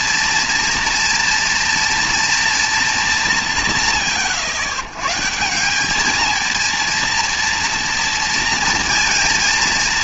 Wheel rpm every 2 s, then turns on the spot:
230, 230, 130, 230, 230.
none